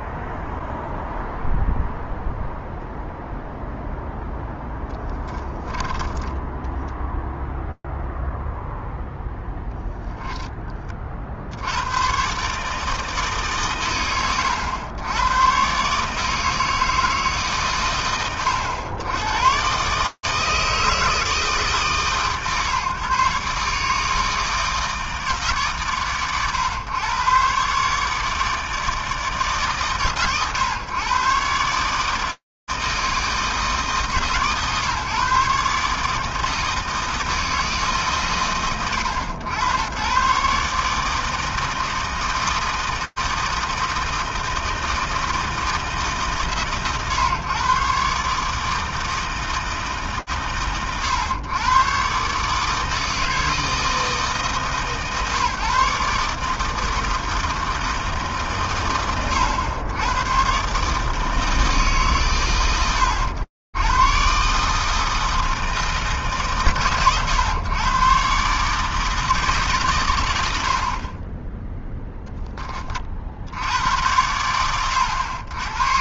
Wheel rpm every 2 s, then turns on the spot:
0, 0, 0, 10, 0, 20, 140, 90, 160, 80, 150, 130, 160, 110, 150, 110, 160, 140, 160, 100, 150, 160, 160, 130, 150, 110, 160, 140, 150, 110, 130, 100, 150, 110, 150, 10, 20, 70.
6-8